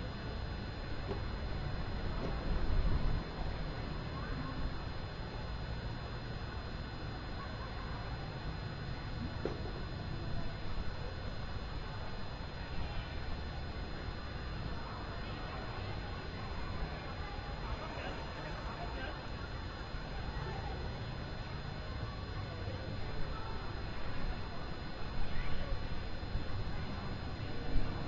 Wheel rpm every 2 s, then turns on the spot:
0, 0, 0, 0, 0, 0, 0, 0, 0, 0, 0, 0, 0, 0.
none